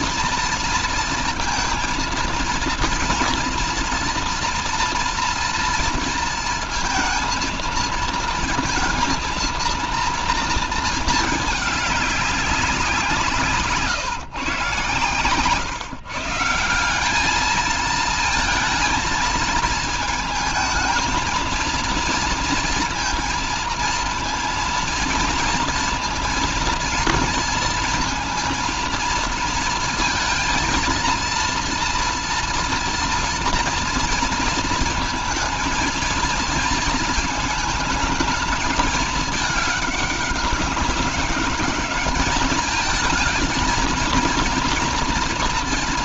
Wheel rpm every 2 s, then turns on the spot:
230, 230, 230, 230, 230, 230, 190, 120, 170, 230, 230, 230, 230, 230, 230, 230, 230, 230, 230, 220, 200, 210, 240.
none